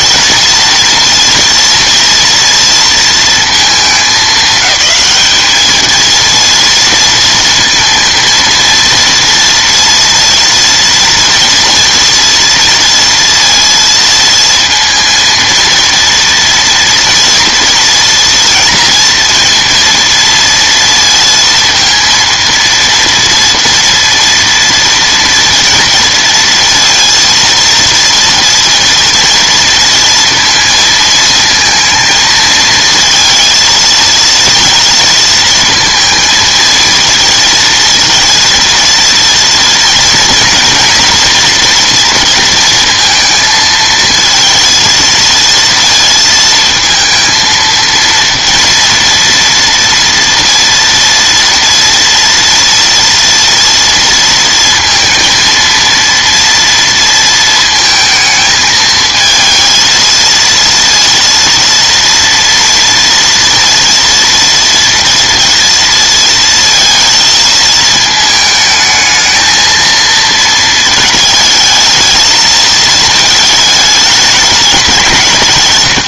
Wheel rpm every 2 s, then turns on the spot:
230, 230, 210, 230, 230, 230, 230, 230, 240, 230, 230, 230, 230, 230, 230, 230, 230, 230, 230, 230, 240, 230, 220, 230, 240, 230, 230, 230, 230, 220, 230, 230, 230, 230, 220, 220, 220, 190.
none